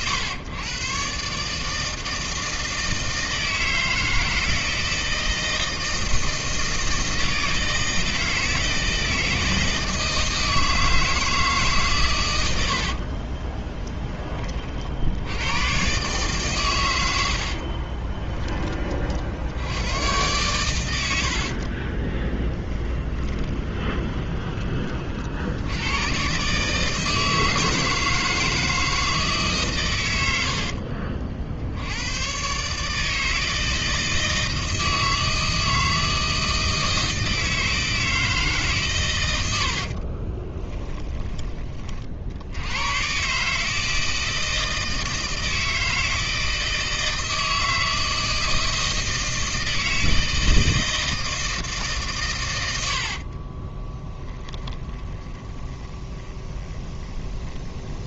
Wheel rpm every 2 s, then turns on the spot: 110, 160, 160, 160, 160, 160, 70, 50, 120, 30, 100, 20, 30, 150, 160, 60, 140, 160, 160, 140, 20, 90, 160, 160, 160, 160, 80, 20, 20.
12-14 22-24 30-32 40-42 54-58